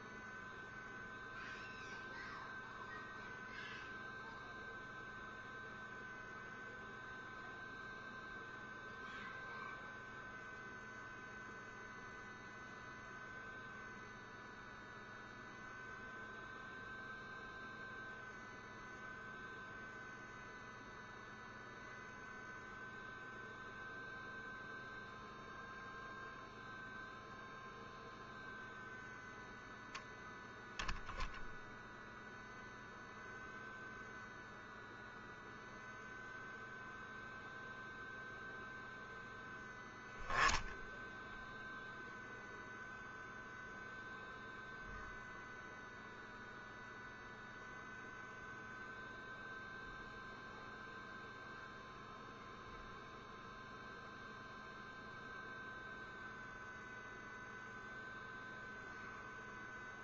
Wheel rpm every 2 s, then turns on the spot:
0, 0, 0, 0, 0, 0, 0, 0, 0, 0, 0, 0, 0, 0, 0, 0, 0, 0, 0, 0, 0, 0, 0, 0, 0, 0, 0, 0, 0, 0.
none